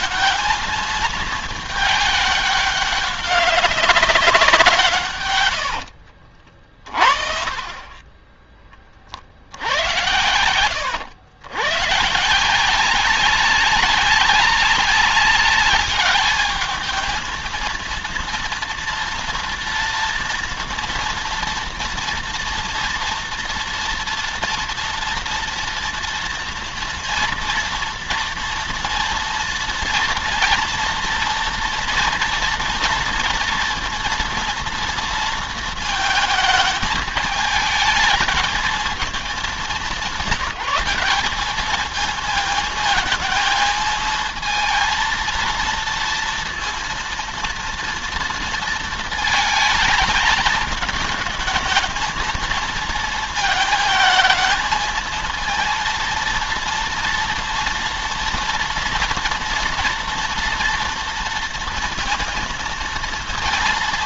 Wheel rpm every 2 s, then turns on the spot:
220, 200, 150, 40, 30, 110, 180, 200, 220, 230, 230, 230, 230, 230, 230, 230, 230, 230, 220, 220, 180, 220, 230, 230, 230, 220, 220, 220, 230, 230, 230, 230.
none